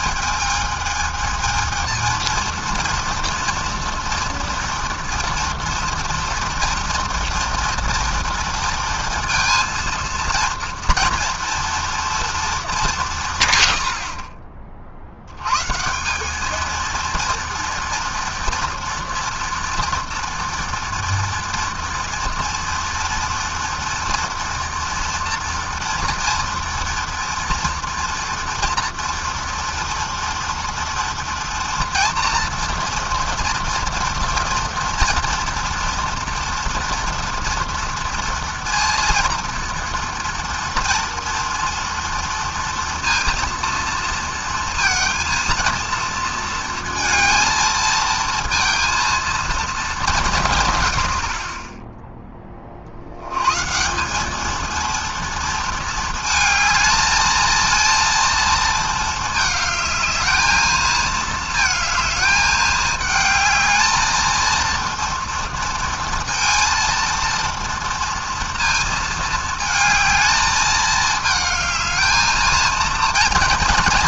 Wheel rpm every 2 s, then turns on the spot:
220, 230, 230, 230, 230, 230, 130, 120, 230, 230, 230, 230, 230, 230, 240, 230, 240, 230, 230, 230, 230, 230, 230, 230, 230, 50, 120, 230, 220, 220, 220, 220, 230, 230, 220, 220, 230.
none